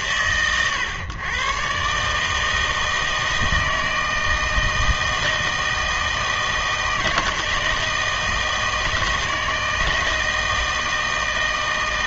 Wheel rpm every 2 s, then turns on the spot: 120, 160, 160, 160, 160, 160.
none